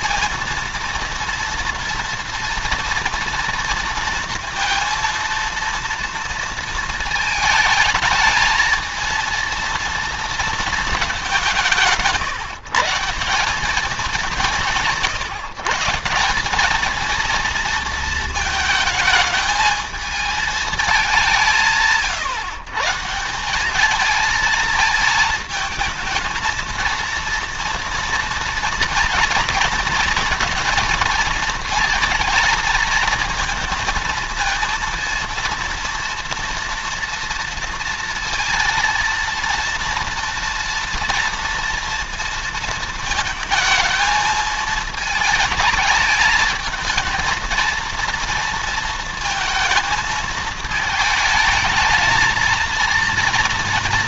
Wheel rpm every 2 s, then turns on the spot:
230, 230, 230, 230, 220, 230, 150, 170, 200, 220, 220, 140, 220, 230, 230, 230, 230, 230, 230, 230, 230, 230, 220, 220, 230, 220, 230.
none